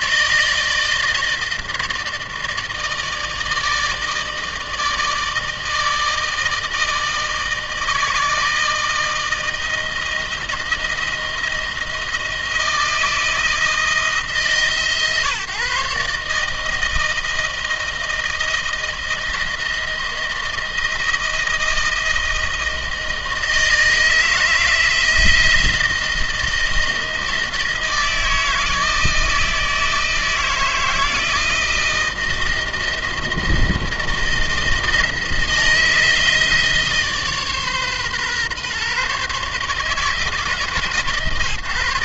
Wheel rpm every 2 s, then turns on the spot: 160, 160, 160, 160, 160, 160, 160, 160, 160, 160, 160, 160, 160, 160, 160, 160, 170, 160, 150, 140, 140.
none